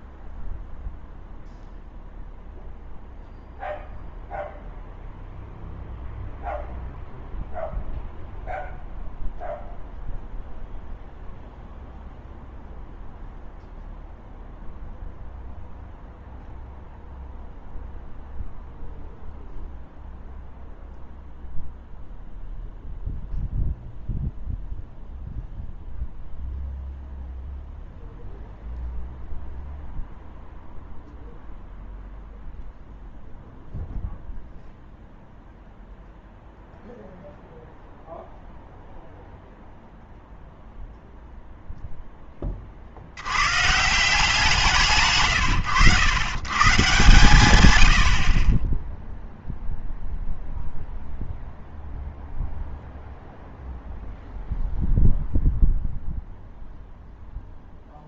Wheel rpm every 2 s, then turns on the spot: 0, 0, 0, 0, 0, 0, 0, 0, 0, 0, 0, 0, 0, 0, 0, 0, 0, 0, 0, 0, 0, 30, 160, 140, 10, 0, 0, 0, 0.
none